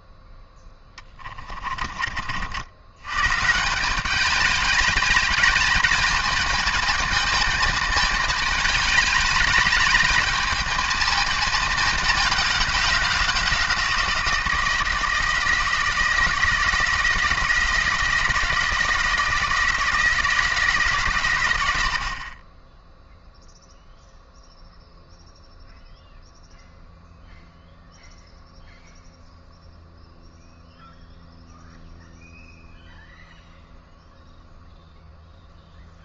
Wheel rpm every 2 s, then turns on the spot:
20, 90, 200, 220, 210, 220, 210, 160, 160, 170, 140, 10, 0, 0, 0, 0, 0, 0.
0-2